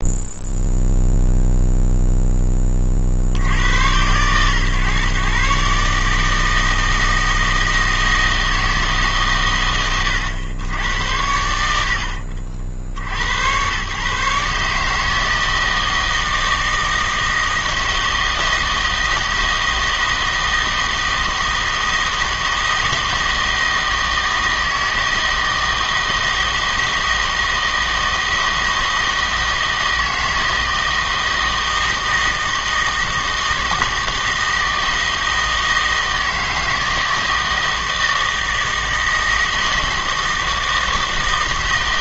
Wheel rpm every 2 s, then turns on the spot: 0, 10, 130, 160, 160, 100, 60, 150, 160, 160, 160, 160, 160, 160, 160, 160, 160, 160, 160, 160, 160.
none